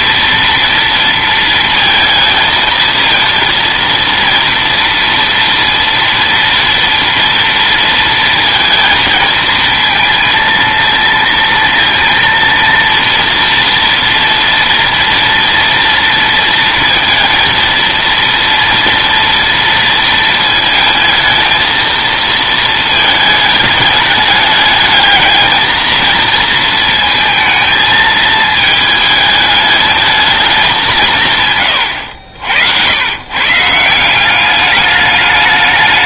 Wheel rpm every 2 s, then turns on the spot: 230, 220, 230, 230, 230, 230, 230, 230, 230, 240, 220, 220, 210, 230, 220, 190, 90, 200.
none